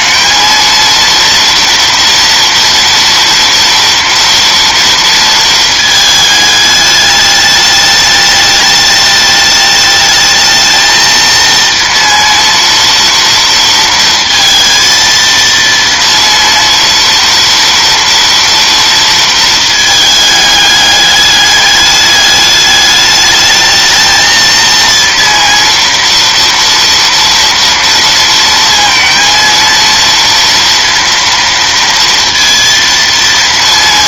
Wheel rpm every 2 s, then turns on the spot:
220, 230, 230, 210, 210, 220, 230, 230, 230, 230, 210, 210, 230, 230, 230, 230, 230.
none